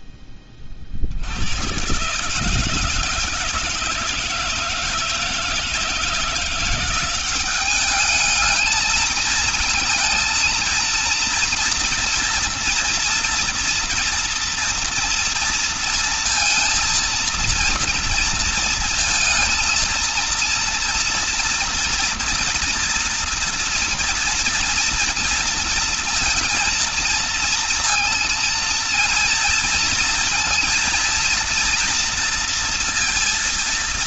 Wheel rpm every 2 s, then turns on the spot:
50, 170, 170, 180, 220, 230, 230, 230, 230, 230, 240, 230, 230, 230, 230, 230, 230.
none